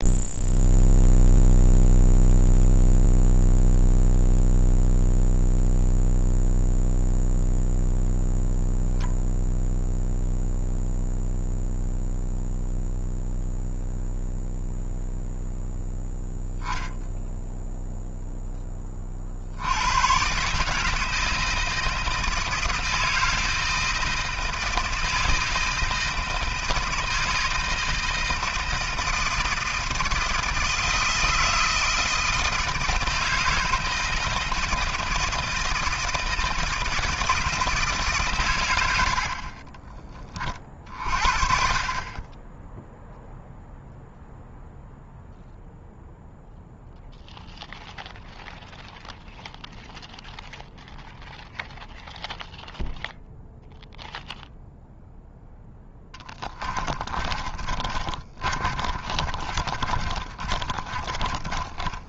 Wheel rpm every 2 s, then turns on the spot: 0, 0, 0, 0, 0, 0, 0, 0, 0, 10, 150, 160, 160, 160, 160, 160, 160, 160, 160, 110, 40, 10, 0, 0, 0, 0, 0, 0, 30, 40, 30.
56-62